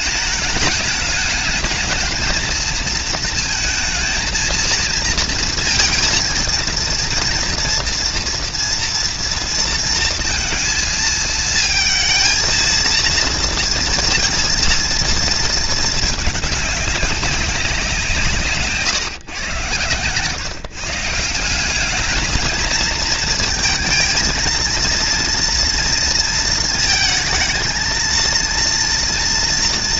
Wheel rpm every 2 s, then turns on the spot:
220, 230, 230, 230, 230, 220, 230, 230, 200, 130, 160, 230, 230, 220, 230.
none